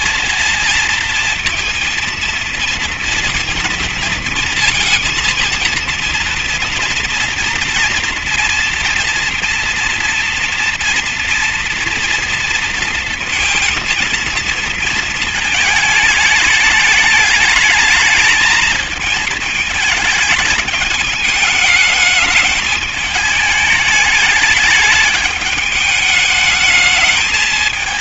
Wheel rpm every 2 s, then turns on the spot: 230, 230, 230, 230, 240, 230, 230, 220, 210, 220, 220, 220, 210, 210.
none